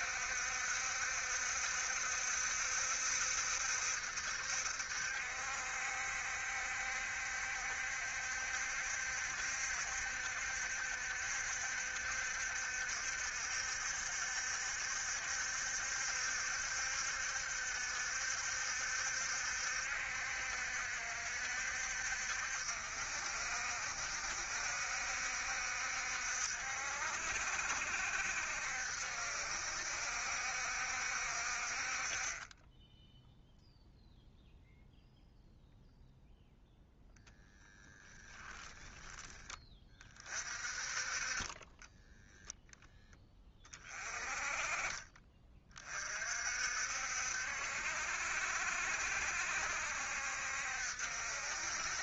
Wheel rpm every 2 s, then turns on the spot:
70, 70, 60, 70, 70, 70, 70, 70, 70, 70, 60, 60, 70, 60, 70, 60, 10, 0, 0, 10, 40, 0, 30, 60, 60, 60.
none